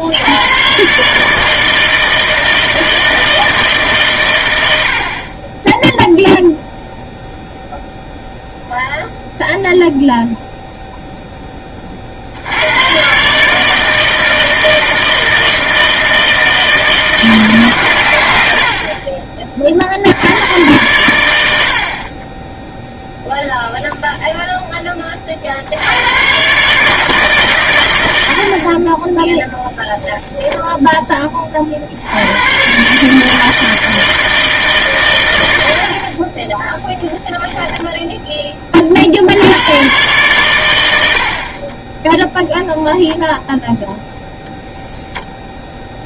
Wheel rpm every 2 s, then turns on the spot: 130, 160, 80, 0, 0, 0, 100, 160, 160, 50, 110, 0, 10, 150, 40, 10, 130, 130, 10, 40, 100, 0, 0.
none